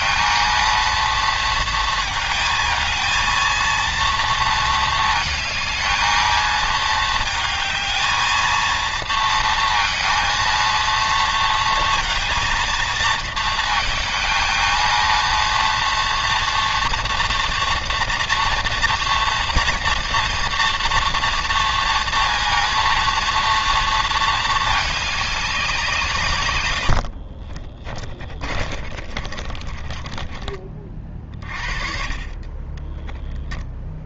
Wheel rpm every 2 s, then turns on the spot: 230, 230, 230, 230, 220, 230, 230, 220, 230, 230, 230, 230, 220, 130, 50, 30, 30.
28-32